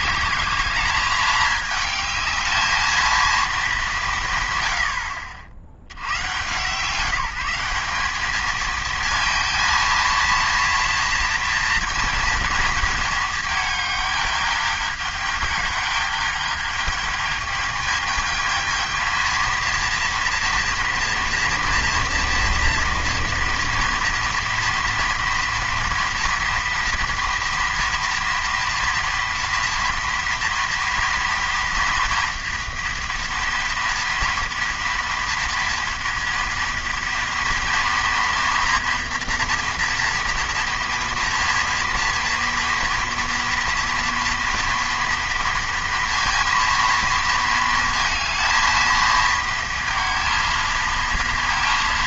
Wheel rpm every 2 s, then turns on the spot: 210, 220, 70, 180, 230, 230, 220, 210, 210, 220, 230, 230, 230, 230, 230, 230, 230, 230, 230, 230, 230, 230, 230, 230, 230, 230.
none